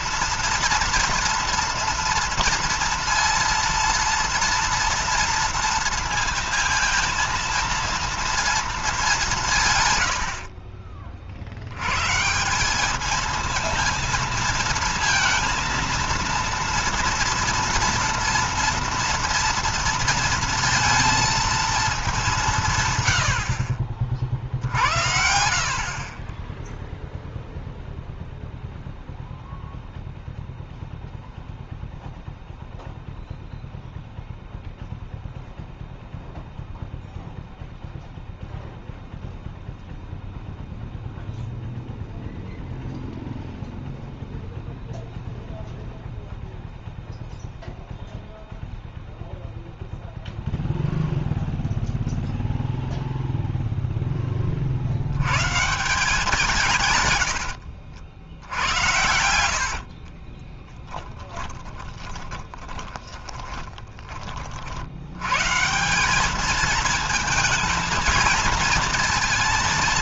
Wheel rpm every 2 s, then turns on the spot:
230, 230, 230, 230, 230, 70, 160, 230, 230, 230, 230, 180, 50, 10, 0, 0, 0, 0, 0, 0, 0, 0, 0, 0, 0, 0, 0, 30, 160, 70, 30, 20, 50, 210, 220.
58-64